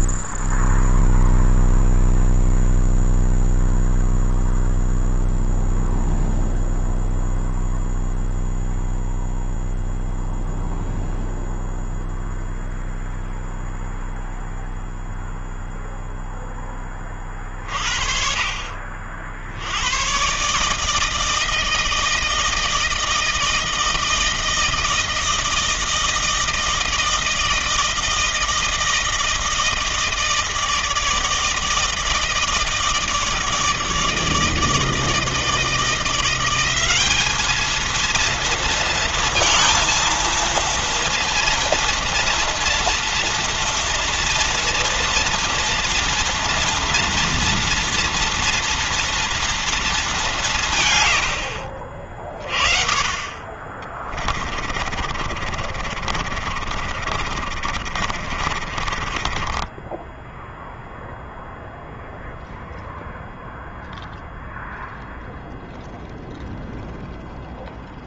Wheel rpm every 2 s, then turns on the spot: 0, 0, 0, 0, 0, 0, 0, 0, 10, 40, 130, 160, 160, 160, 160, 160, 160, 160, 180, 230, 230, 230, 230, 230, 230, 180, 40, 30, 50, 40, 0, 0, 0, 0.
54-60